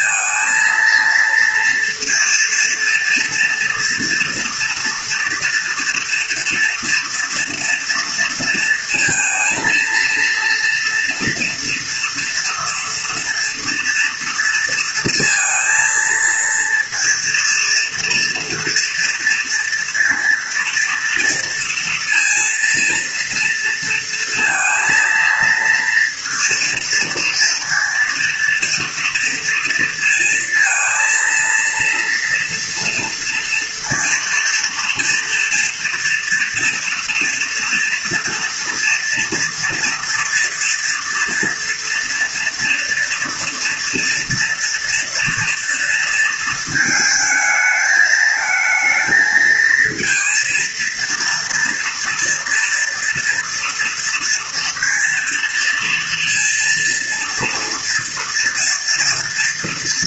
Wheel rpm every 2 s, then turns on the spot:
230, 240, 230, 240, 230, 230, 230, 230, 230, 230, 230, 230, 230, 230, 230, 230, 230, 230, 230, 230, 240, 230, 230, 220, 220, 230, 240, 230, 230, 230.
none